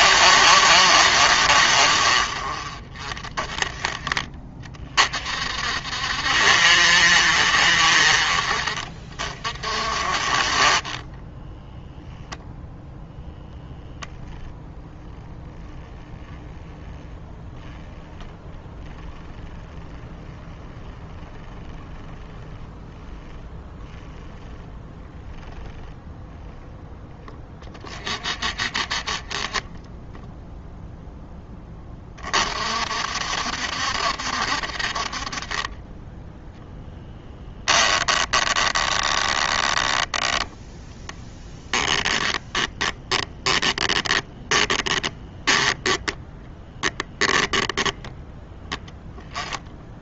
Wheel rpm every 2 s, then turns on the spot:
60, 30, 40, 70, 40, 20, 0, 0, 10, 10, 10, 0, 0, 10, 20, 0, 60, 50, 10, 10, 10, 10, 10, 0, 10.
36-46